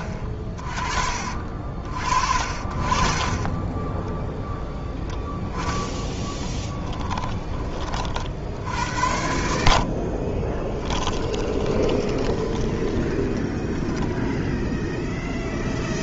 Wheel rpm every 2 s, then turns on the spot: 40, 50, 0, 20, 70, 20, 10, 0.
6-8 10-14